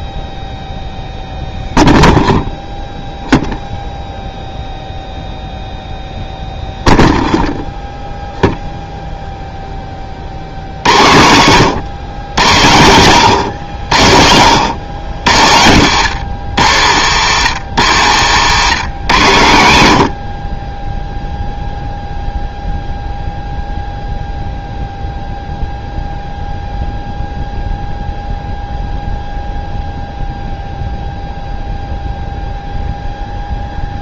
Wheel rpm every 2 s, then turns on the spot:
0, 0, 0, 0, 0, 70, 110, 100, 120, 150, 30, 0, 0, 0, 0, 0, 0.
none